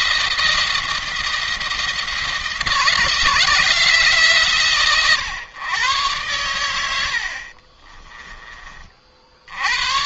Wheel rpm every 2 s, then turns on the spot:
170, 170, 140, 90, 30.
6-8